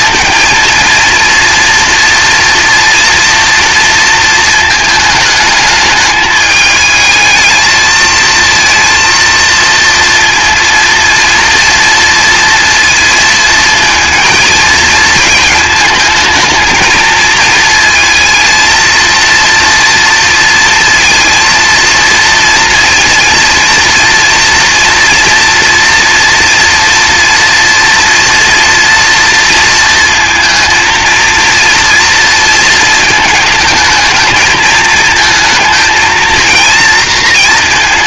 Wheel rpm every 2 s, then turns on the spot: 230, 230, 220, 220, 230, 230, 230, 220, 220, 230, 230, 230, 230, 230, 230, 230, 220, 220, 230.
none